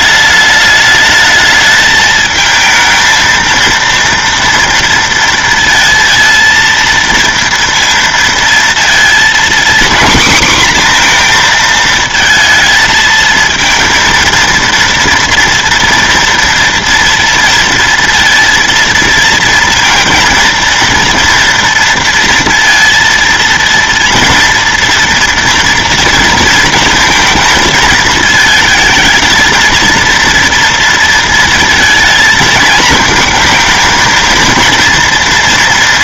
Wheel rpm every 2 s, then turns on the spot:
210, 220, 230, 230, 230, 240, 220, 230, 230, 230, 230, 230, 230, 230, 220, 230, 220, 230.
none